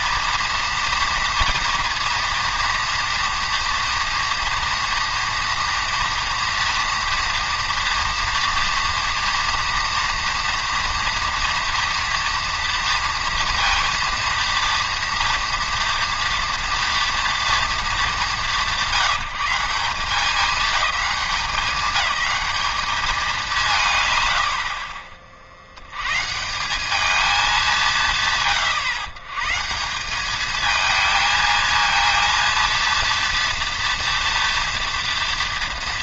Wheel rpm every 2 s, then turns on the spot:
230, 230, 230, 230, 240, 230, 230, 230, 230, 170, 210, 220, 80, 180, 140, 220, 230, 240.
none